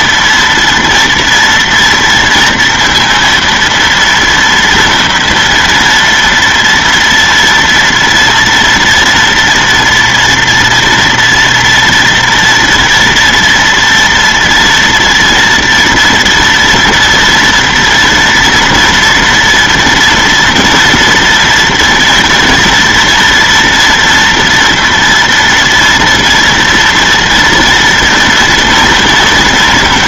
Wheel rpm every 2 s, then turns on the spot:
230, 230, 240, 230, 230, 230, 230, 230, 230, 230, 230, 240, 230, 230, 230.
none